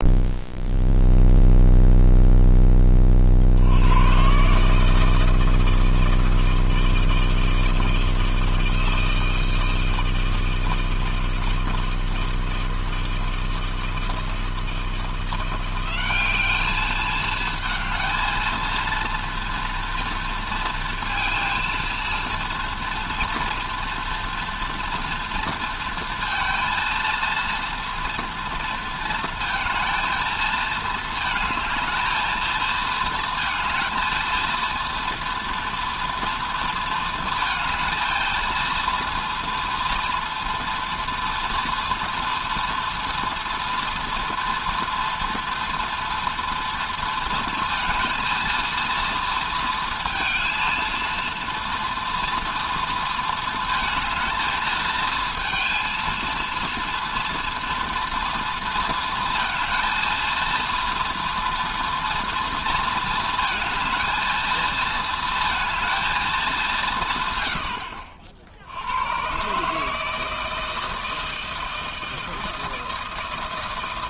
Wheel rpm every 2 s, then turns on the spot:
0, 20, 150, 160, 160, 160, 160, 160, 210, 230, 230, 240, 230, 230, 230, 220, 220, 230, 230, 230, 230, 230, 240, 230, 230, 230, 230, 220, 230, 230, 230, 230, 230, 160, 90, 160, 160.
none